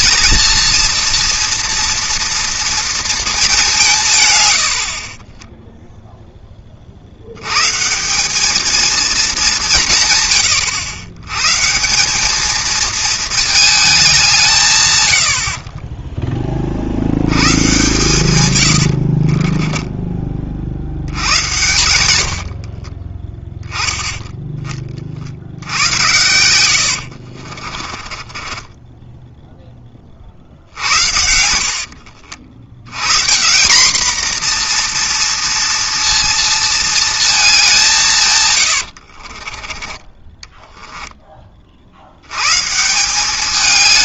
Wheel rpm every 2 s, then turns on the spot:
230, 230, 80, 30, 220, 100, 220, 150, 30, 100, 50, 40, 20, 90, 20, 60, 90, 240, 230, 120, 10, 140.
4-6 18-20 26-32 38-42